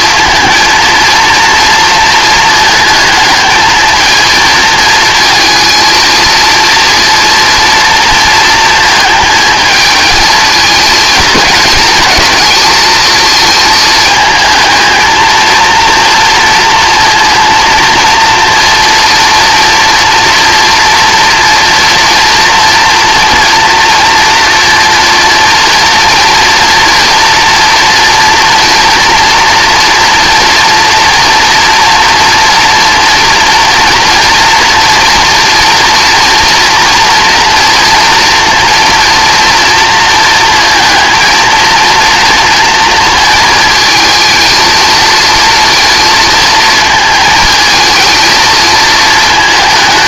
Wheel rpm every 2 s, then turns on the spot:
230, 220, 230, 230, 230, 220, 220, 220, 230, 230, 230, 230, 230, 230, 230, 230, 230, 230, 230, 230, 230, 230, 220, 230, 220.
none